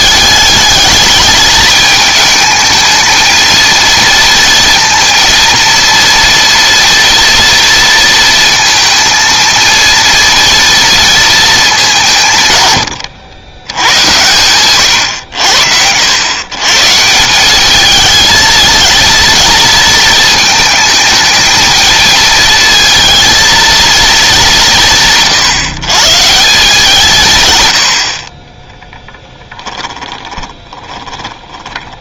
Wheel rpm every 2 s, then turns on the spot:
210, 220, 230, 230, 230, 230, 110, 120, 140, 230, 220, 220, 170, 160, 10, 20.
30-32